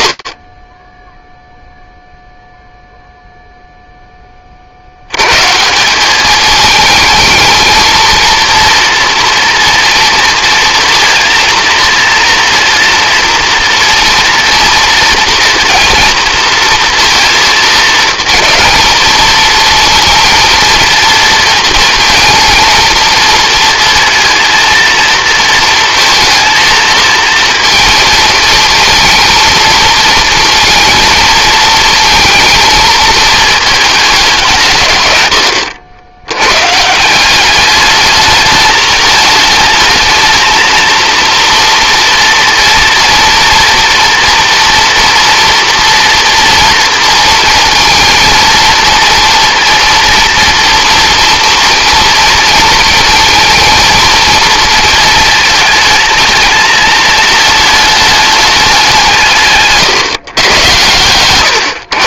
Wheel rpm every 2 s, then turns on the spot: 0, 0, 80, 220, 230, 230, 240, 240, 230, 220, 230, 230, 230, 230, 230, 230, 230, 130, 160, 220, 230, 240, 230, 230, 230, 230, 220, 230, 220, 180, 120.
none